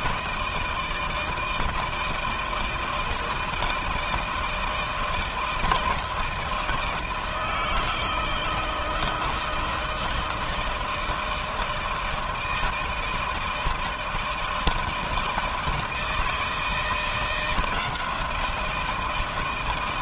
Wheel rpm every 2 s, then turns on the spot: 160, 160, 160, 160, 160, 170, 160, 160, 160, 160.
none